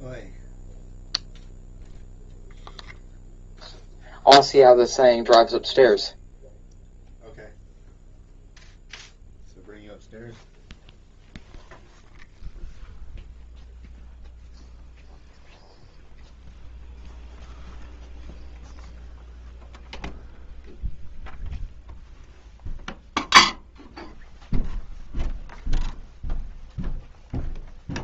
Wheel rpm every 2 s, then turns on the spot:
0, 0, 0, 0, 0, 0, 0, 0, 0, 0, 0, 0, 0, 0.
none